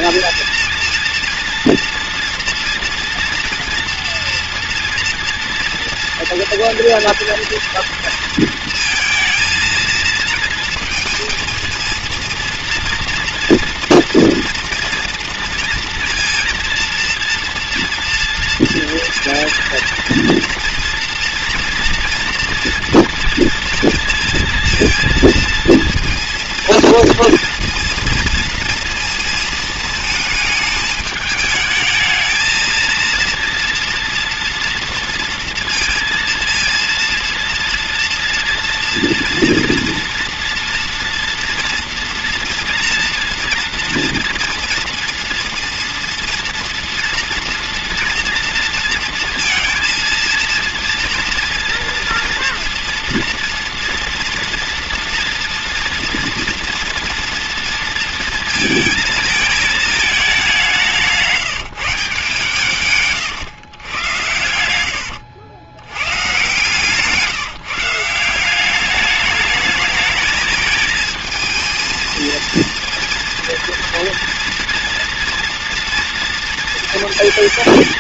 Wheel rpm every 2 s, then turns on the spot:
230, 230, 230, 230, 230, 230, 230, 230, 230, 230, 230, 230, 230, 230, 230, 210, 230, 230, 230, 240, 240, 230, 230, 230, 230, 230, 230, 240, 240, 220, 190, 150, 80, 140, 190, 220, 230, 230, 230.
64-66